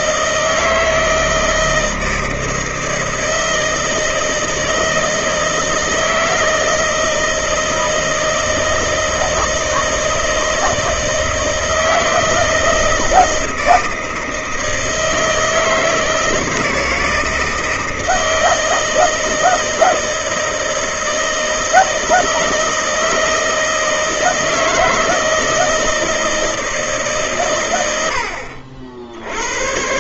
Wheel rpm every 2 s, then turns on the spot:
160, 160, 160, 160, 160, 160, 160, 160, 160, 160, 160, 160, 160, 160, 60.
none